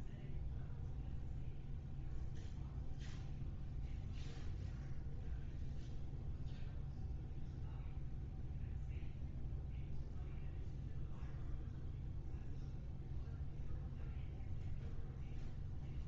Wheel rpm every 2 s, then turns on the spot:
0, 0, 0, 0, 0, 0, 0, 0.
none